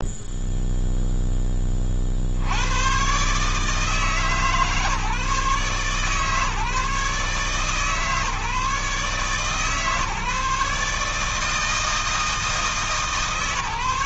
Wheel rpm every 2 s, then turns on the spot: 0, 60, 150, 150, 150, 150, 160.
none